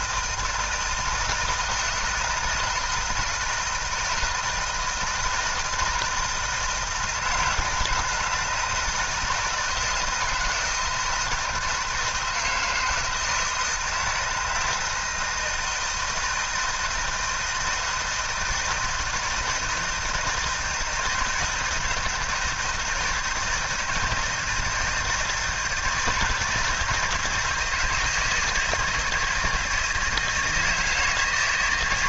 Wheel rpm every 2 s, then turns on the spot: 160, 160, 160, 160, 160, 160, 160, 160, 160, 160, 160, 160, 160, 170, 160, 160.
none